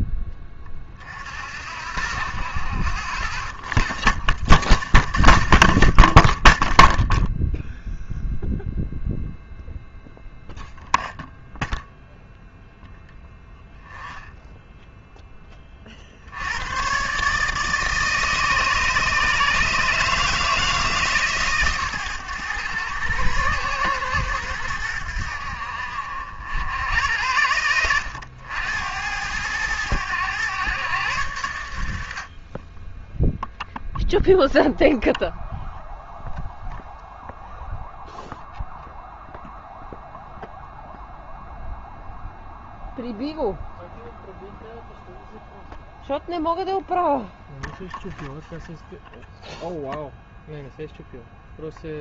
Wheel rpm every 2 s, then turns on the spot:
30, 40, 50, 0, 0, 0, 0, 0, 100, 150, 160, 110, 100, 80, 90, 110, 20, 0, 0, 0, 0, 0, 0, 0, 0, 0.
none